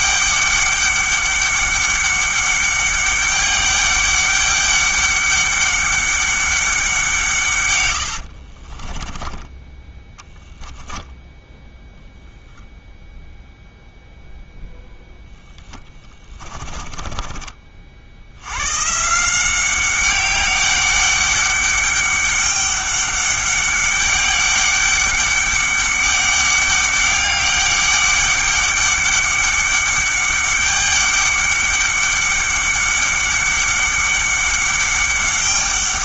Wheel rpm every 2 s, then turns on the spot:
200, 200, 200, 190, 40, 0, 0, 0, 20, 120, 200, 200, 200, 200, 200, 200, 200, 200.
8-10 16-18